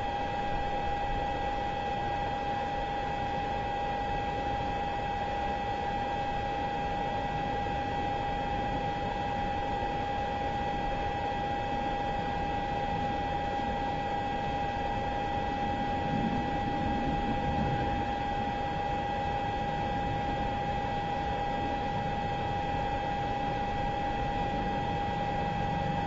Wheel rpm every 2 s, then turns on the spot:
0, 0, 0, 0, 0, 0, 0, 0, 0, 0, 0, 0, 0.
none